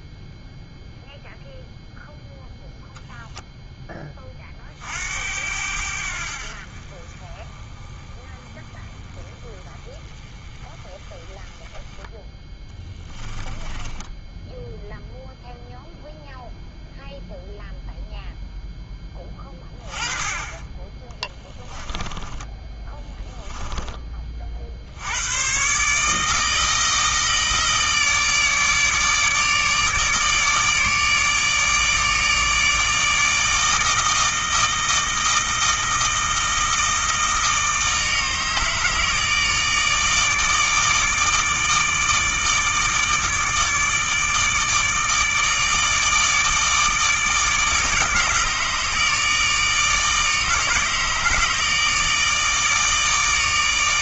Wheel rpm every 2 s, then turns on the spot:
0, 0, 60, 40, 20, 20, 10, 0, 0, 10, 20, 10, 80, 160, 150, 150, 160, 160, 160, 160, 160, 150, 160, 160, 150, 150, 150.
12-14 22-24